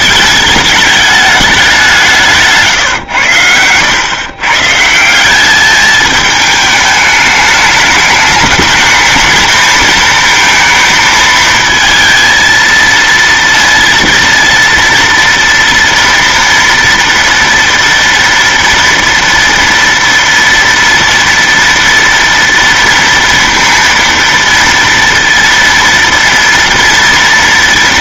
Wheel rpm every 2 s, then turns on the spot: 200, 150, 140, 210, 210, 230, 230, 230, 230, 230, 240, 230, 230, 230.
2-4